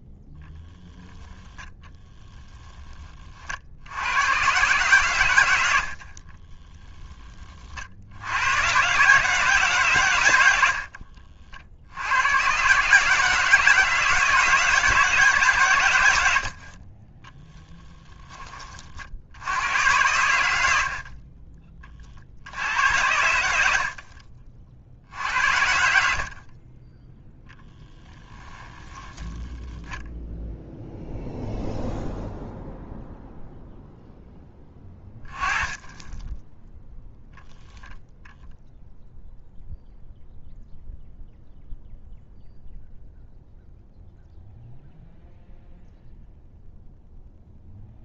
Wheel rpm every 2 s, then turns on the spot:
10, 20, 120, 20, 130, 70, 140, 160, 30, 50, 50, 100, 60, 20, 10, 0, 0, 10, 0, 0, 0, 0, 0, 0.
10-12 28-30